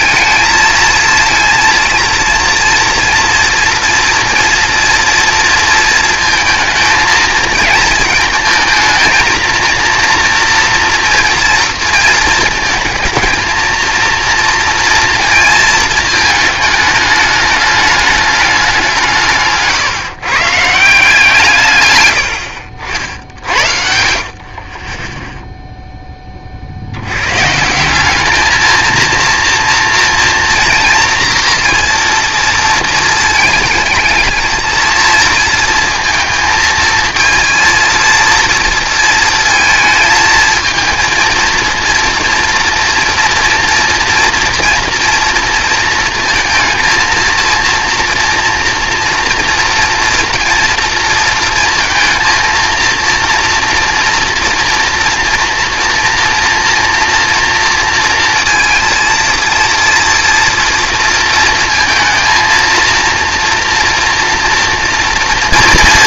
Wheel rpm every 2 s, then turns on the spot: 220, 230, 230, 230, 230, 240, 220, 240, 220, 190, 150, 80, 40, 40, 220, 230, 230, 220, 220, 230, 220, 240, 240, 230, 230, 230, 230, 230, 240, 230, 230, 230, 230.
22-24